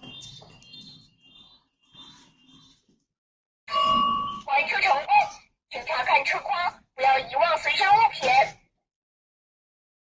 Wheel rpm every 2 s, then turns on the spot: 0, 0, 0, 0, 0.
none